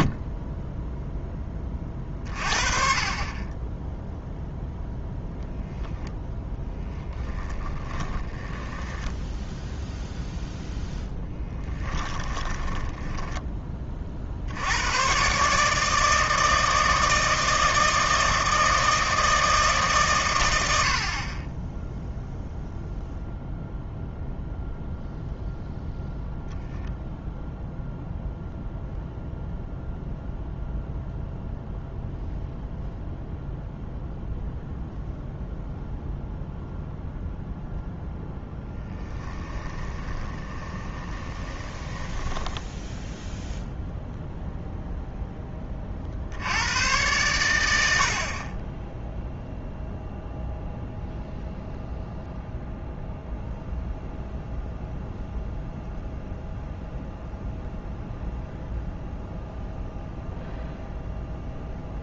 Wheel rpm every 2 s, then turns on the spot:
10, 40, 0, 0, 10, 0, 10, 90, 160, 160, 80, 0, 0, 0, 0, 0, 0, 0, 0, 10, 20, 10, 0, 100, 20, 0, 0, 0, 0, 0, 0.
8-10 12-14 38-44